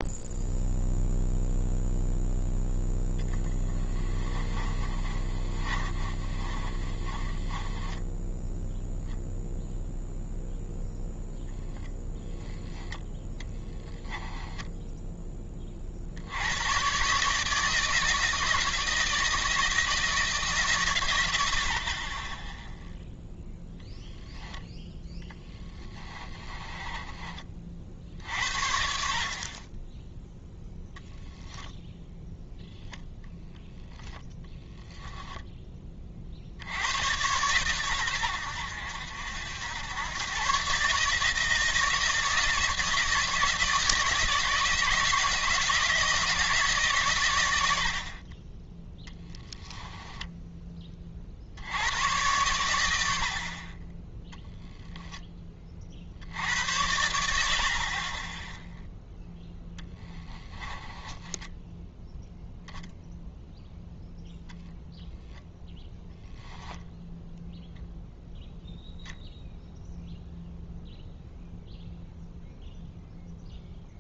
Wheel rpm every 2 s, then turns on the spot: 0, 0, 30, 30, 0, 0, 0, 0, 120, 160, 150, 10, 10, 20, 60, 0, 10, 10, 90, 80, 140, 160, 160, 140, 10, 30, 70, 0, 80, 0, 10, 0, 0, 0, 0, 0, 0.
4-8 26-28 60-62